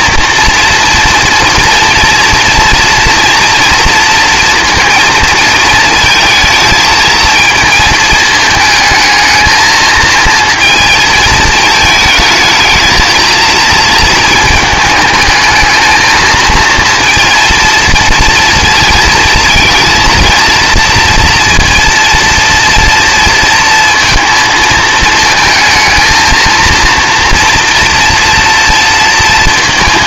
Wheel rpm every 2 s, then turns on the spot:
240, 240, 230, 220, 220, 220, 220, 220, 230, 230, 230, 230, 220, 230, 230.
none